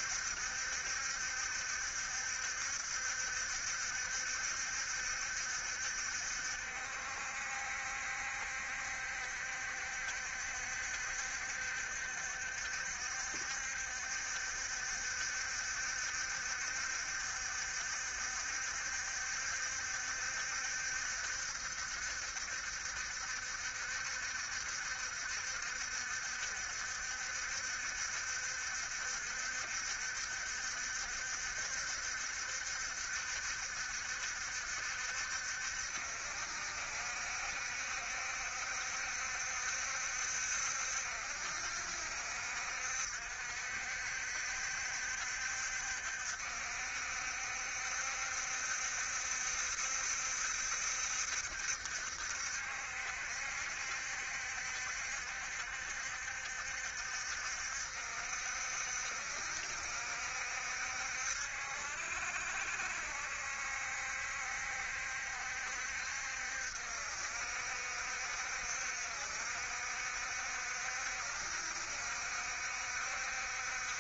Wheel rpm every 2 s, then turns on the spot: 70, 70, 70, 60, 70, 70, 60, 70, 70, 60, 70, 70, 60, 60, 60, 70, 70, 60, 60, 70, 60, 60, 70, 60, 70, 70, 60, 70, 70, 60, 70, 70, 70, 70, 70, 60, 70.
none